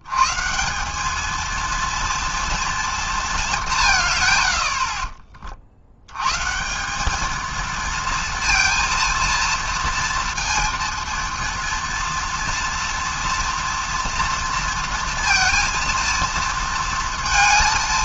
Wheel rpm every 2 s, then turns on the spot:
160, 230, 80, 150, 230, 230, 240, 230, 230.
none